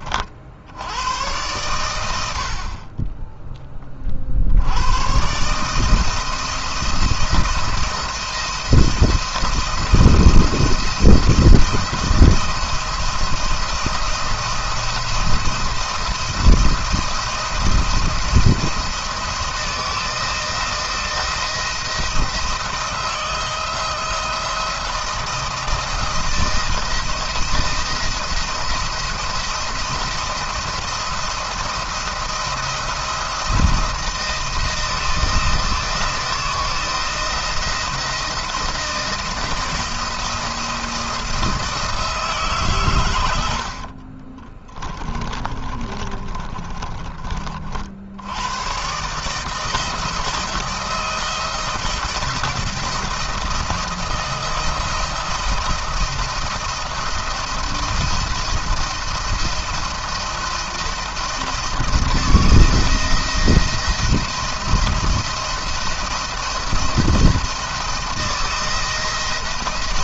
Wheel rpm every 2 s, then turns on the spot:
70, 40, 90, 170, 170, 170, 170, 170, 170, 170, 170, 160, 160, 160, 170, 170, 170, 160, 170, 170, 170, 130, 20, 20, 120, 160, 170, 170, 170, 170, 170, 170, 170, 170, 170.
44-48